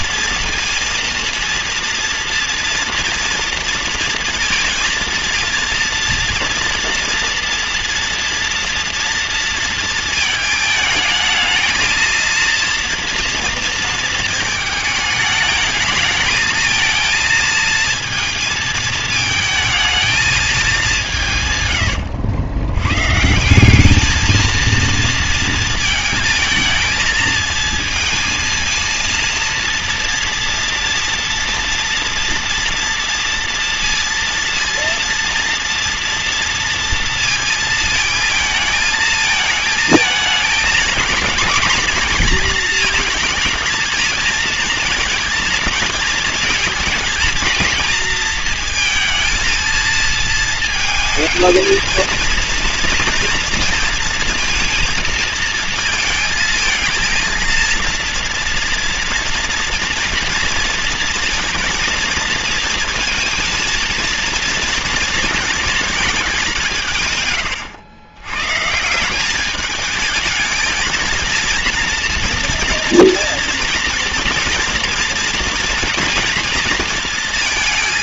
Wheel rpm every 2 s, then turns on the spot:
230, 240, 230, 230, 230, 220, 230, 220, 220, 220, 210, 100, 230, 220, 230, 230, 230, 230, 230, 220, 220, 230, 230, 230, 230, 230, 230, 230, 230, 230, 230, 230, 230, 170, 140, 230, 230, 230, 230.
none